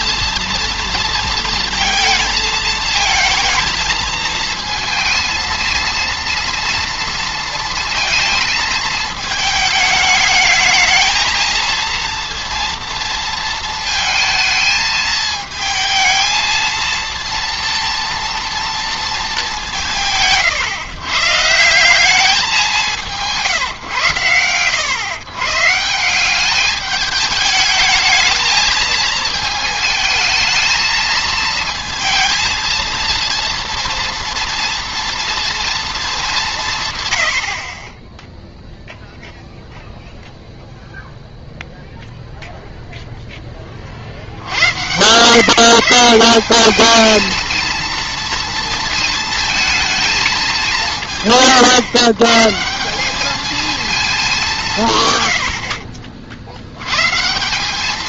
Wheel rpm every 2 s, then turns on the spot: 230, 220, 220, 230, 220, 220, 230, 220, 230, 230, 140, 190, 110, 210, 220, 220, 230, 230, 170, 0, 0, 0, 100, 200, 230, 180, 160, 190, 90.
none